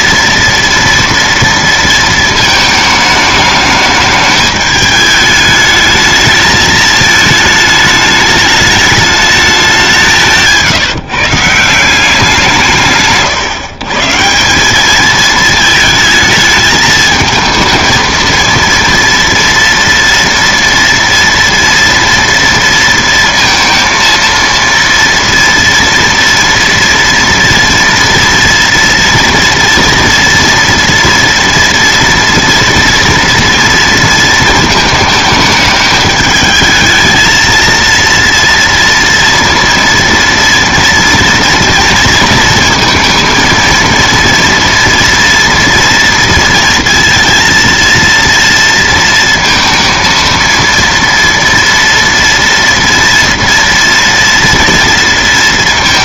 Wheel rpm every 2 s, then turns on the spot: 230, 220, 210, 220, 210, 160, 160, 200, 220, 230, 230, 230, 230, 230, 230, 230, 230, 220, 220, 230, 230, 230, 230, 230, 230, 230, 230, 230.
none